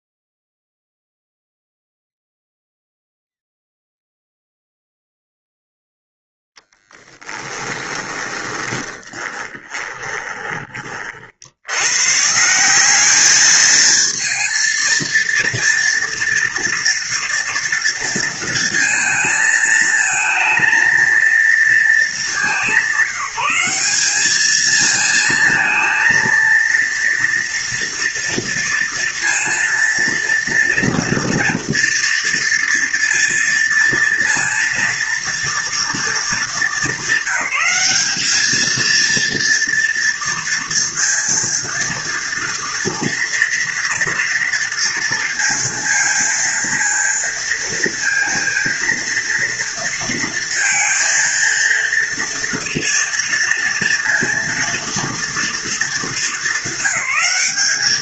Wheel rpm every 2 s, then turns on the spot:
0, 0, 0, 10, 20, 60, 200, 230, 230, 220, 230, 190, 230, 230, 230, 230, 230, 230, 210, 230, 230, 230, 230, 230, 230, 230, 230, 230, 200.
6-10